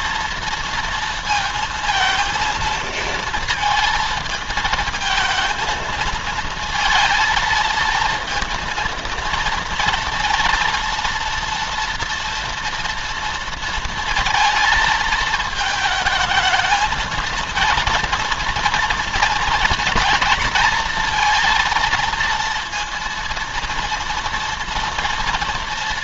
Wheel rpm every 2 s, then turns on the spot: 230, 230, 220, 220, 230, 230, 230, 220, 220, 230, 230, 230, 230.
none